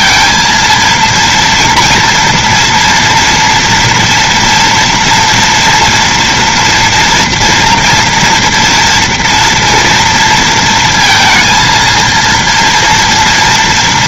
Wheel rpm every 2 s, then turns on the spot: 230, 240, 230, 230, 230, 230, 230.
none